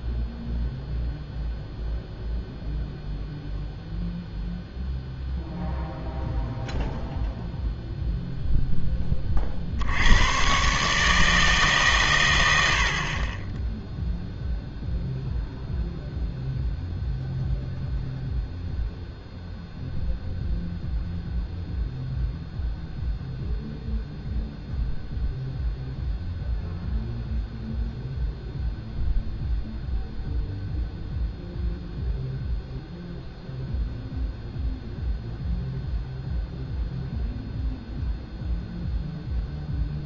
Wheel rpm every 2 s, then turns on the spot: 0, 0, 0, 0, 0, 130, 100, 0, 0, 0, 0, 0, 0, 0, 0, 0, 0, 0, 0, 0.
none